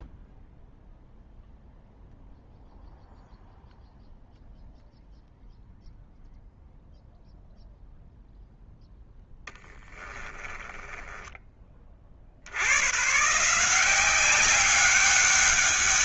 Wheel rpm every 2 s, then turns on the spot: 0, 0, 0, 0, 0, 10, 90, 190.
10-12